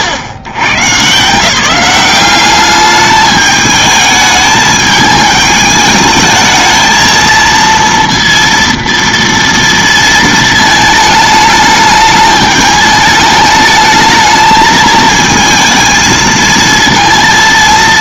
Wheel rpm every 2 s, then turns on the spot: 110, 200, 210, 220, 230, 220, 210, 220, 220.
none